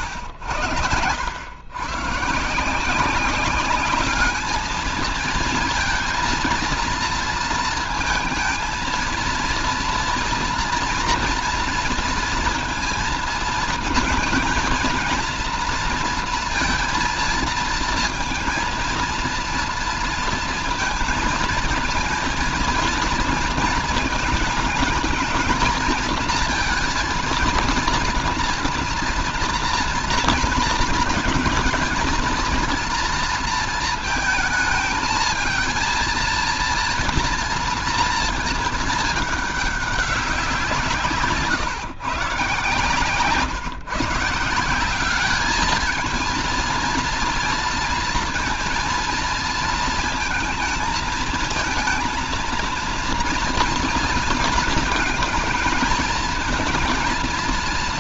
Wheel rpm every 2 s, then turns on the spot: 100, 140, 210, 230, 230, 230, 230, 220, 230, 230, 230, 230, 220, 230, 230, 230, 230, 220, 230, 230, 190, 120, 150, 230, 230, 220, 230, 230, 220.
none